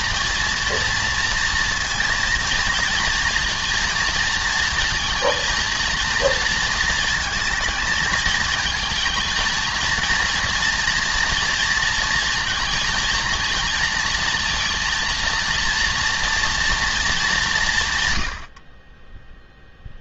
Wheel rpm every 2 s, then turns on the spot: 230, 230, 230, 220, 230, 230, 230, 230, 220, 20.
none